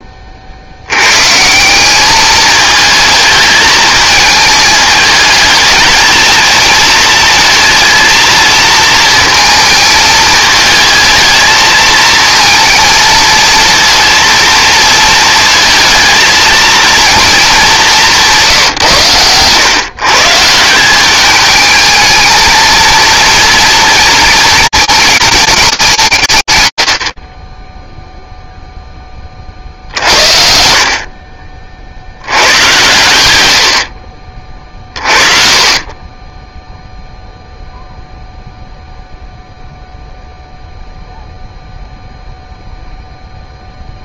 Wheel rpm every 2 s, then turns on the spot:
80, 220, 220, 230, 230, 220, 220, 230, 230, 130, 180, 230, 220, 70, 10, 50, 100, 30, 0, 0, 0, 0.
none